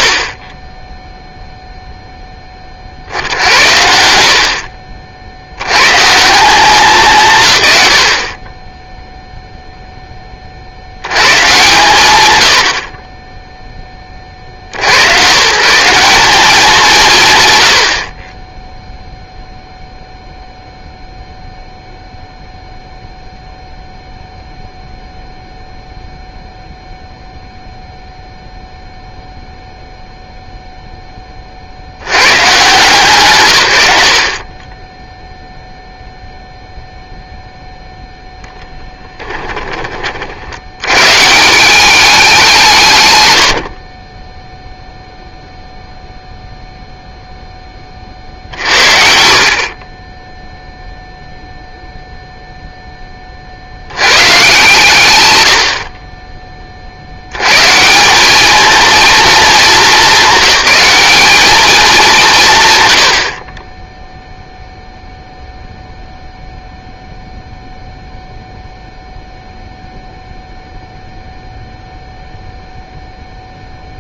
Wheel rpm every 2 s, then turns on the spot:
40, 40, 40, 190, 20, 110, 50, 90, 180, 0, 0, 0, 0, 0, 0, 0, 130, 0, 0, 10, 70, 170, 0, 0, 50, 0, 0, 120, 40, 230, 200, 120, 0, 0, 0, 0, 0.
none